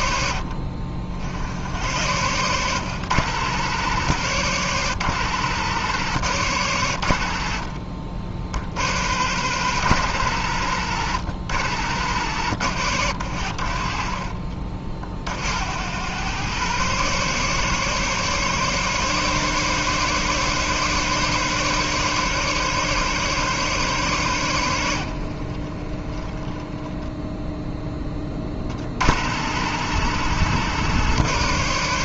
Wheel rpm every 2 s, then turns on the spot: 50, 110, 110, 100, 70, 100, 100, 50, 120, 140, 140, 140, 90, 10, 50, 120.
none